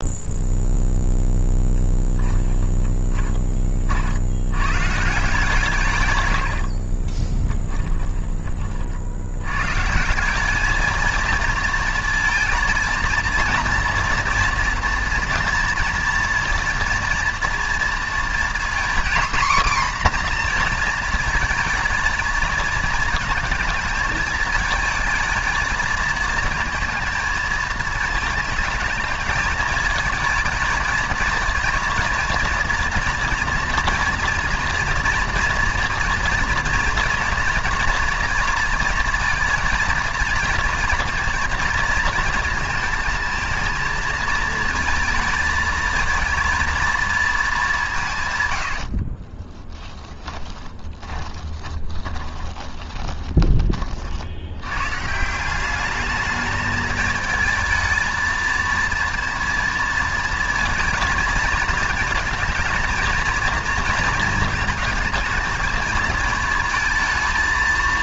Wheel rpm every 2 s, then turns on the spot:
10, 40, 140, 20, 120, 230, 230, 230, 230, 260, 220, 220, 230, 220, 220, 230, 230, 240, 240, 230, 230, 220, 220, 190, 20, 20, 30, 190, 220, 230, 230, 230, 220, 220.
6-8 48-52